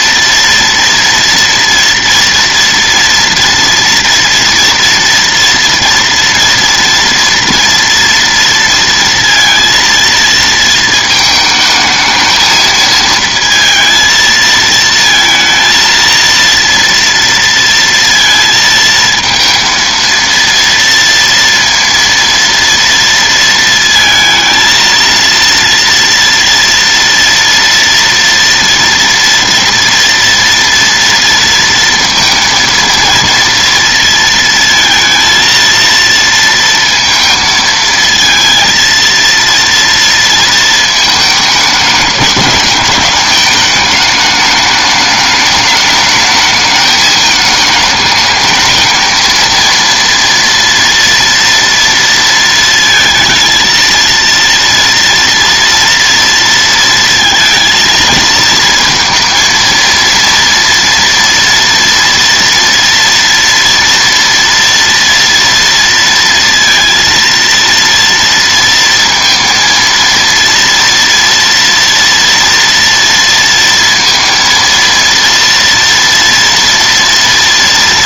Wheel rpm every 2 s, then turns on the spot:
230, 230, 230, 230, 230, 220, 220, 230, 230, 220, 230, 230, 230, 230, 230, 230, 230, 230, 230, 230, 220, 210, 210, 210, 230, 230, 220, 230, 230, 230, 230, 230, 230, 230, 230, 230, 230, 230, 230.
none